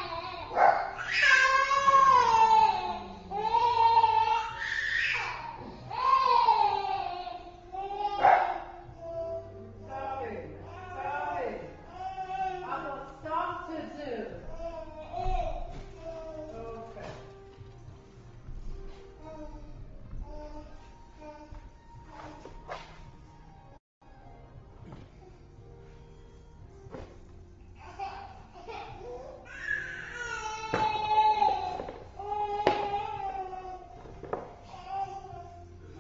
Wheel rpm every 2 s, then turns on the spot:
0, 0, 0, 0, 0, 0, 0, 0, 0, 0, 0, 0, 0, 0, 0, 0, 0, 0.
none